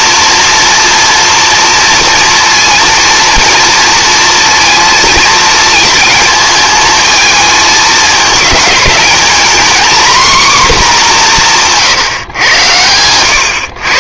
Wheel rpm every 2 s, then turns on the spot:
230, 230, 230, 220, 210, 240, 110.
none